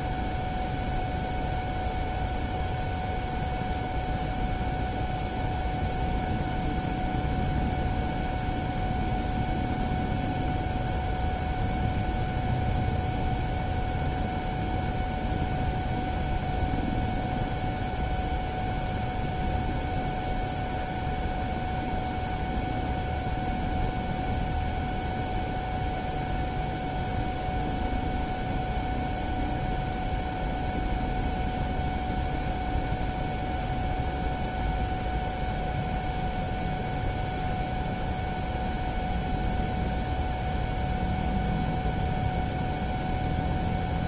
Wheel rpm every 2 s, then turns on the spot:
0, 0, 0, 0, 0, 0, 0, 0, 0, 0, 0, 0, 0, 0, 0, 0, 0, 0, 0, 0, 0, 0.
none